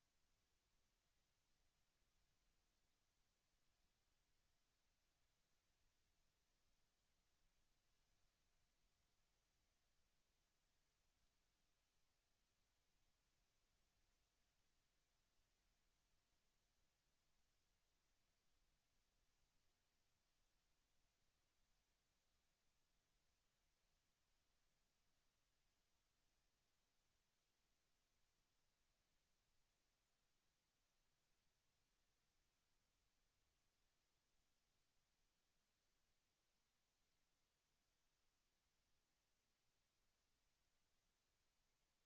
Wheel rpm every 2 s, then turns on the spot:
0, 0, 0, 0, 0, 0, 0, 0, 0, 0, 0, 0, 0, 0, 0, 0, 0, 0, 0, 0, 0.
none